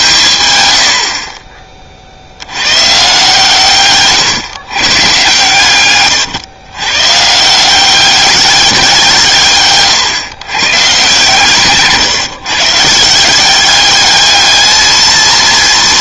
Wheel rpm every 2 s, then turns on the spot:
130, 100, 130, 110, 200, 130, 140, 210.
none